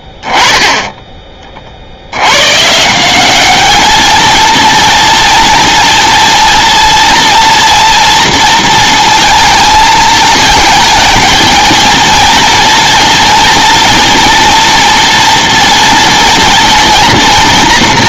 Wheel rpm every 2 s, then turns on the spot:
20, 120, 230, 230, 230, 220, 230, 230, 230.
none